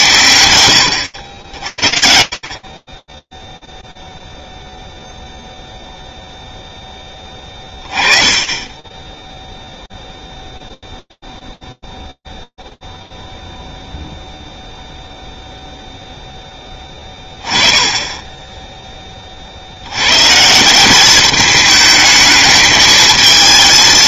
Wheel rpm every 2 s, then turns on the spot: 100, 40, 0, 0, 10, 0, 0, 0, 10, 20, 190, 220.
none